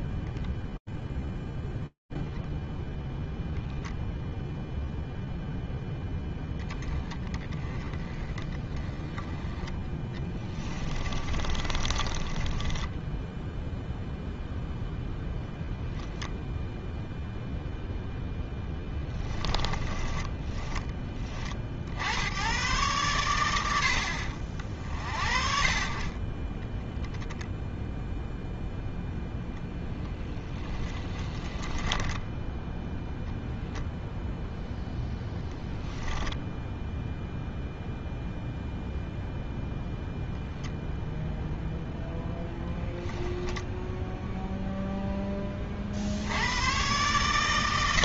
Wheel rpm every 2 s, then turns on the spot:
0, 0, 0, 20, 20, 30, 0, 0, 10, 20, 120, 50, 30, 0, 10, 20, 0, 10, 0, 0, 0, 0, 40, 160.
8-12 16-18 28-32